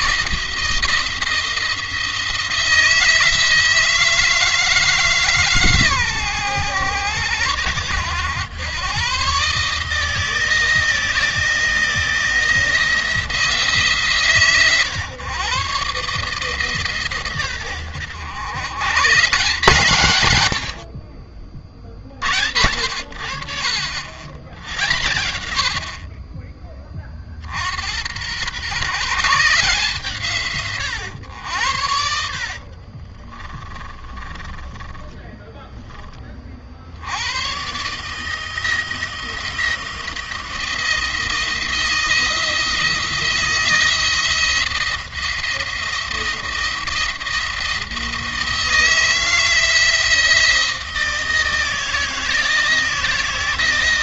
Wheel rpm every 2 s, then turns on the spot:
170, 170, 160, 110, 110, 160, 170, 130, 140, 130, 70, 80, 100, 30, 140, 120, 40, 10, 60, 170, 170, 170, 170, 170, 160, 170, 170.
32-36